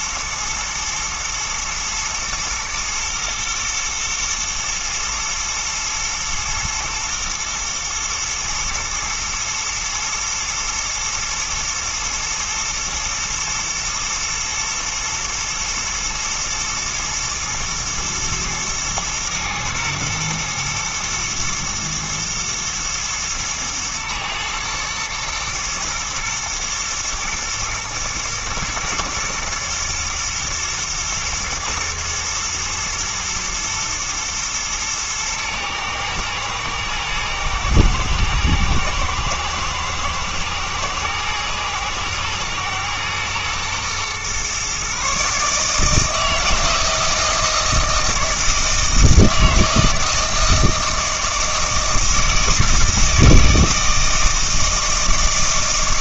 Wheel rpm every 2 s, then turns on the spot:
120, 120, 120, 110, 110, 120, 110, 120, 120, 110, 110, 120, 120, 110, 120, 120, 120, 110, 110, 110, 110, 120, 130, 160, 160, 160, 160, 160.
none